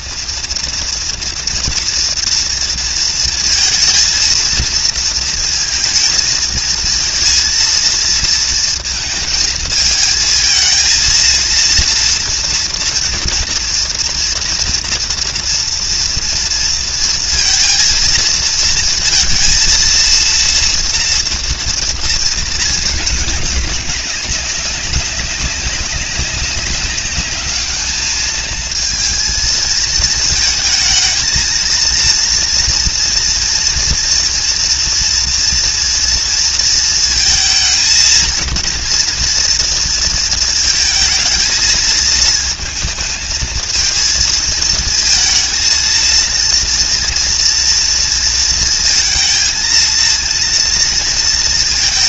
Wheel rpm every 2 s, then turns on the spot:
230, 230, 230, 230, 230, 220, 230, 230, 230, 230, 230, 210, 190, 200, 220, 230, 230, 230, 230, 230, 220, 220, 220, 230, 230, 230.
none